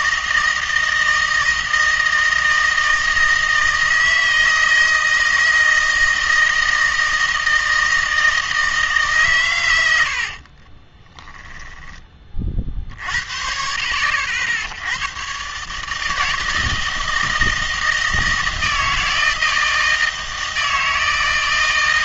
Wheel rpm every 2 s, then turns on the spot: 160, 160, 160, 160, 160, 40, 40, 70, 160, 160, 160.
10-12